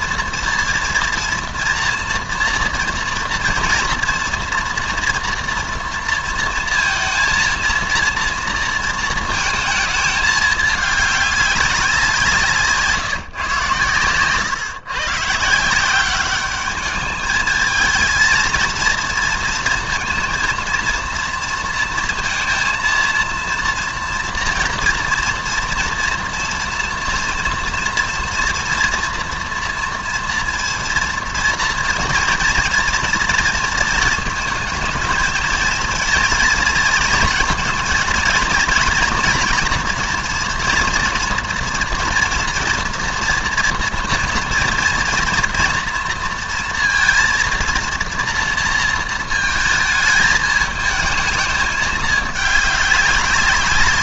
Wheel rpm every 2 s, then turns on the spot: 230, 230, 230, 230, 230, 210, 160, 130, 210, 230, 230, 230, 230, 230, 230, 230, 230, 220, 230, 230, 240, 230, 230, 230, 230, 210, 200.
none